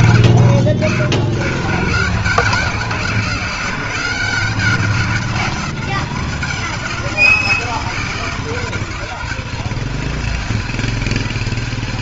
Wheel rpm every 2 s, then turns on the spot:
70, 140, 180, 190, 190, 230.
none